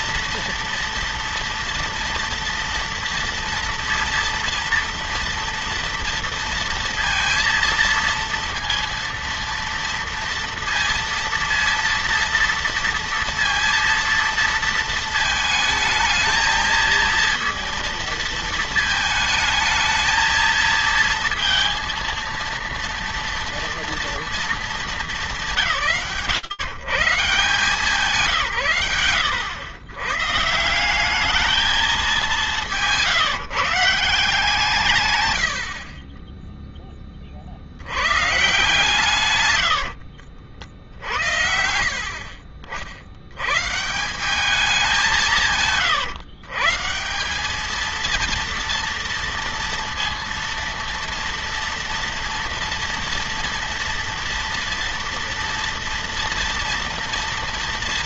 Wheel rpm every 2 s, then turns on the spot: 230, 230, 230, 230, 230, 230, 230, 230, 220, 220, 220, 230, 190, 150, 110, 180, 180, 140, 20, 140, 80, 70, 180, 160, 230, 230, 230, 230, 230.
none